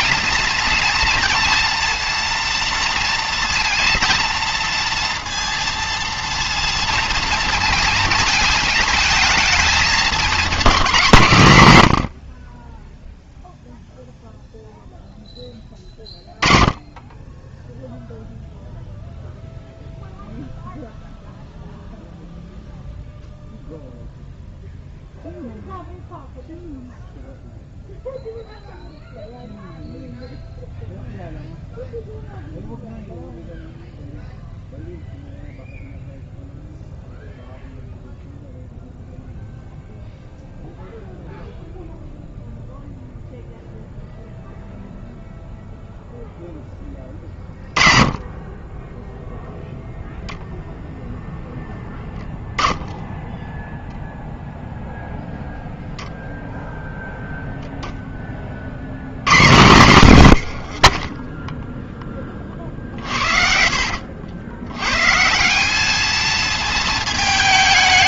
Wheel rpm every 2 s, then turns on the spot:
230, 230, 230, 230, 220, 210, 30, 0, 10, 0, 0, 0, 0, 0, 0, 0, 0, 0, 0, 0, 0, 0, 0, 10, 20, 0, 0, 0, 0, 40, 80, 40, 100, 220.
60-64